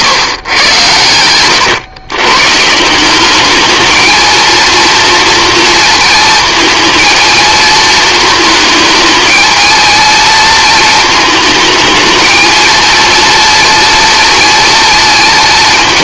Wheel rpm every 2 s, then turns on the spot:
110, 170, 230, 230, 220, 220, 230, 230.
none